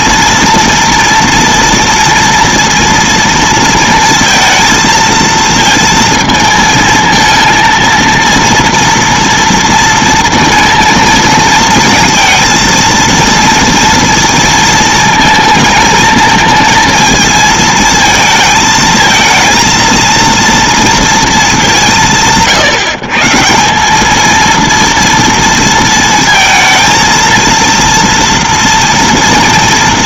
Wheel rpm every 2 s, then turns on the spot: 230, 230, 230, 220, 230, 230, 230, 230, 220, 220, 230, 160, 230, 230, 230.
none